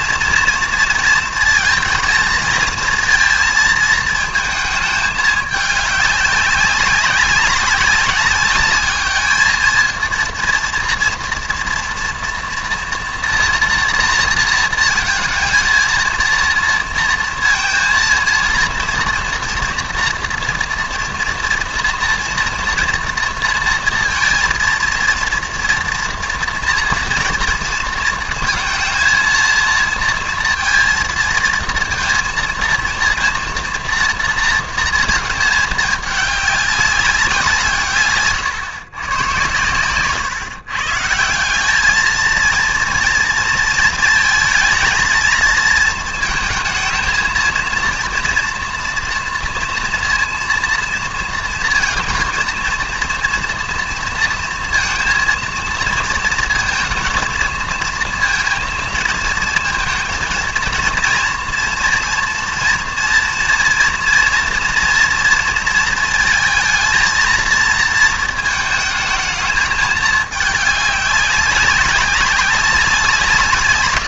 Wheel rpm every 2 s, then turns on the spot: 230, 230, 220, 200, 200, 230, 230, 230, 230, 230, 230, 230, 230, 230, 230, 230, 230, 230, 200, 130, 120, 230, 230, 230, 240, 230, 230, 230, 230, 230, 230, 240, 230, 230, 220, 210, 190.
none